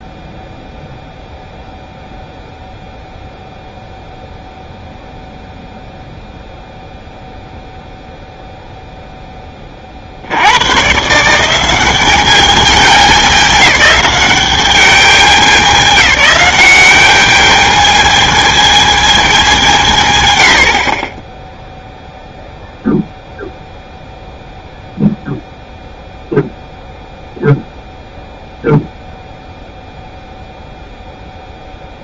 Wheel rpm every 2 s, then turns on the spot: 0, 0, 0, 0, 0, 120, 200, 200, 190, 220, 70, 0, 0, 0, 0, 0.
none